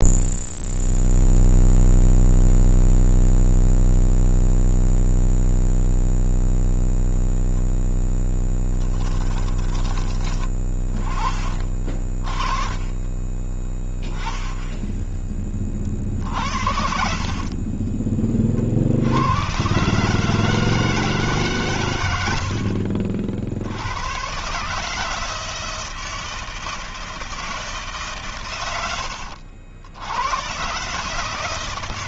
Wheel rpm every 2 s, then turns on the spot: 0, 0, 0, 0, 10, 20, 20, 10, 50, 70, 150, 50, 150, 160, 90, 140.
8-10 12-14 16-18